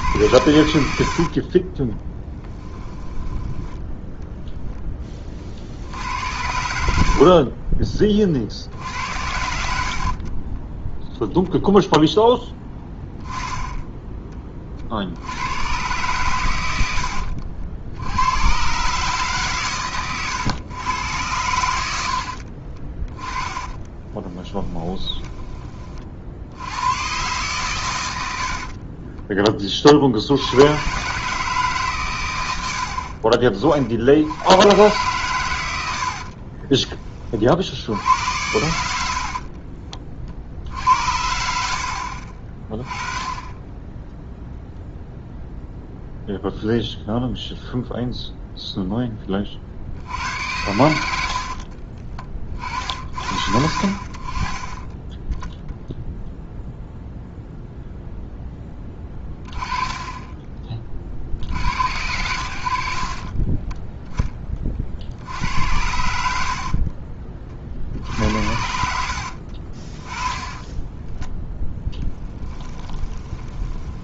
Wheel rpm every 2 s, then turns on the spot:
70, 10, 10, 80, 60, 20, 10, 30, 90, 120, 120, 40, 10, 90, 60, 90, 90, 100, 40, 80, 50, 30, 0, 0, 0, 90, 40, 30, 0, 10, 20, 80, 30, 60, 70, 10, 10.
2-4 6-8 10-12 22-26 28-30 36-38 66-68 70-74